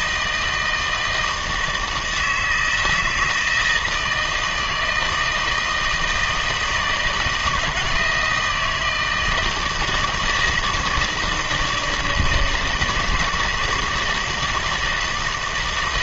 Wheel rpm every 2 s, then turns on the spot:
160, 160, 160, 160, 170, 160, 160, 160.
none